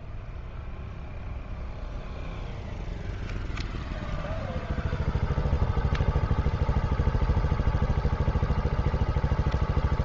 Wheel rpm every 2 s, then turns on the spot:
0, 0, 0, 0, 0.
none